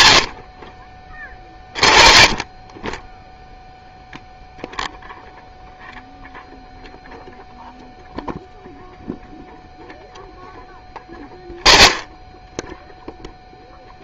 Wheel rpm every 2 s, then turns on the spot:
30, 10, 0, 0, 0, 10, 0.
none